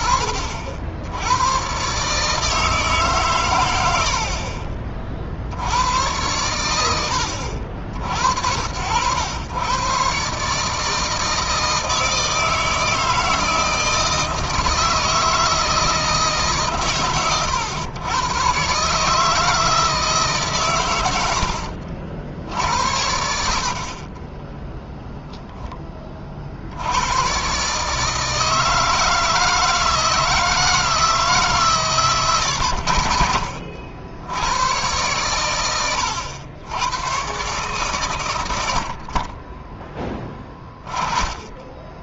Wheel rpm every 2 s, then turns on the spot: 80, 150, 50, 100, 80, 150, 160, 160, 140, 120, 130, 60, 10, 60, 160, 160, 90, 100, 90, 90, 20.
24-26